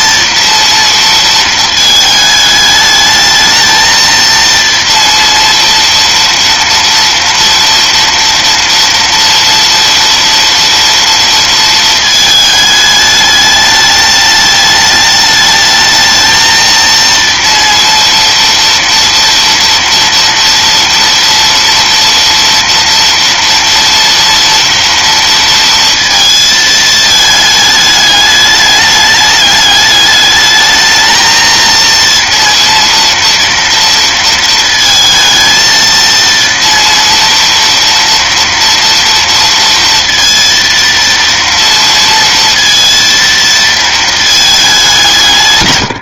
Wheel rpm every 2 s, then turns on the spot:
230, 210, 230, 230, 230, 230, 220, 210, 220, 230, 230, 230, 230, 220, 210, 220, 230, 230, 230, 230, 230, 230, 210.
none